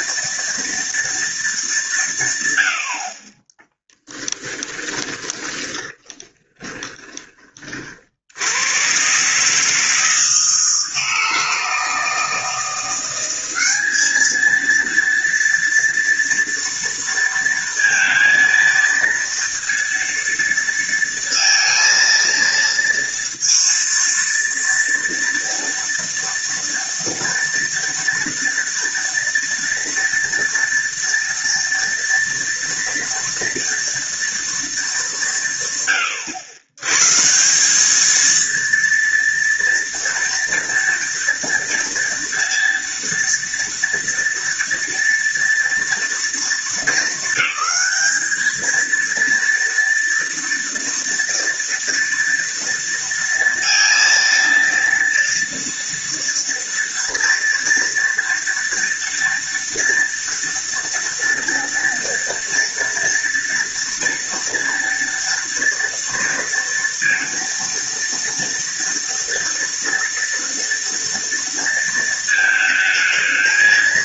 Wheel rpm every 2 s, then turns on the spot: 230, 80, 20, 20, 100, 160, 170, 220, 230, 230, 230, 230, 230, 230, 230, 230, 230, 230, 100, 230, 230, 230, 230, 200, 230, 230, 230, 230, 230, 230, 230, 230, 230, 230, 230, 230, 220.
4-8